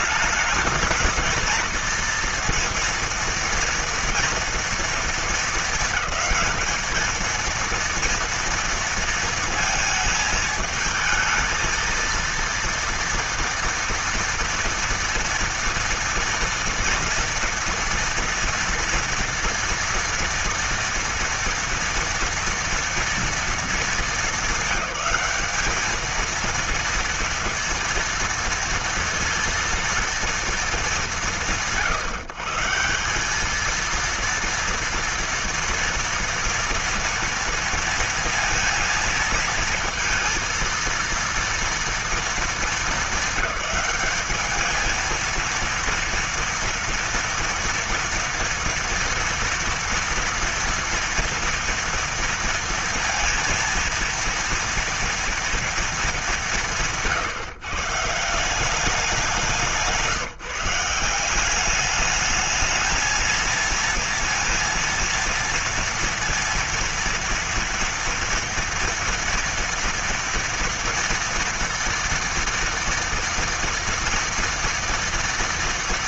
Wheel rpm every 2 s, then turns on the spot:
210, 230, 230, 210, 230, 220, 230, 240, 230, 230, 230, 230, 210, 220, 230, 230, 140, 230, 230, 230, 220, 230, 210, 230, 230, 230, 230, 230, 200, 170, 160, 210, 230, 230, 230, 230, 230, 230.
none